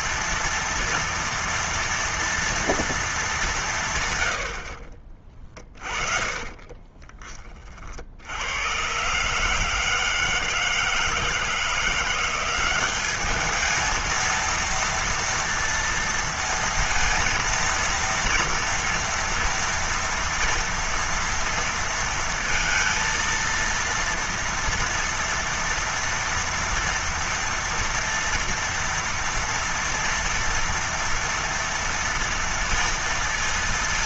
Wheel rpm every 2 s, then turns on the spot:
230, 220, 40, 20, 110, 160, 200, 230, 230, 230, 230, 230, 230, 230, 230, 230, 230.
6-8